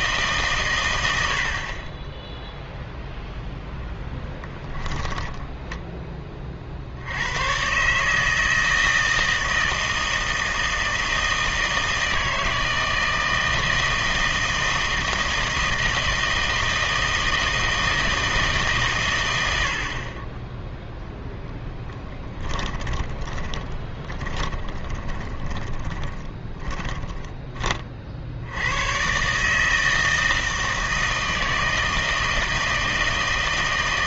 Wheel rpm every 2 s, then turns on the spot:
130, 0, 10, 40, 160, 160, 160, 160, 160, 150, 10, 10, 20, 10, 80, 160, 160.
4-6 22-28